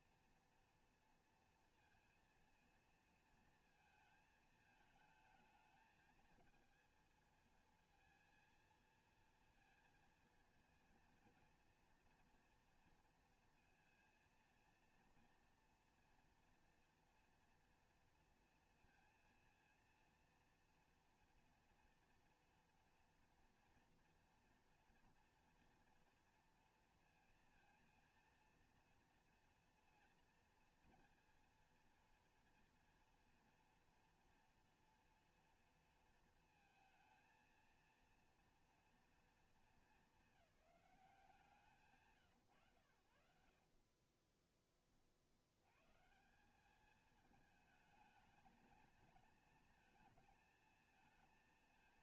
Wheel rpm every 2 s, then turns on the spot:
240, 230, 220, 220, 230, 230, 230, 230, 230, 230, 230, 230, 230, 230, 230, 230, 230, 240, 230, 230, 210, 110, 20, 190, 220, 230.
none